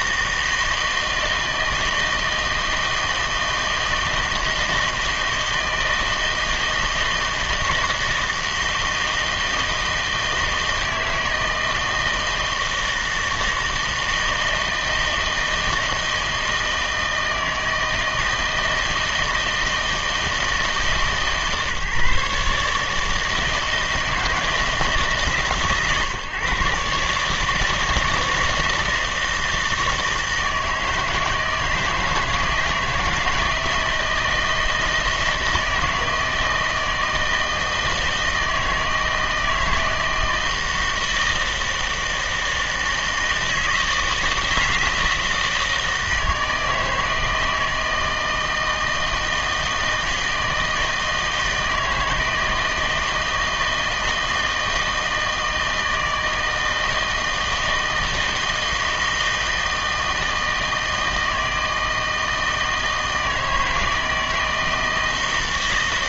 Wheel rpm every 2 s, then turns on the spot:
160, 160, 160, 160, 160, 160, 160, 160, 160, 160, 150, 150, 150, 140, 160, 160, 160, 160, 160, 160, 160, 160, 160, 160, 160, 160, 160, 160, 160, 160, 160, 160, 160.
none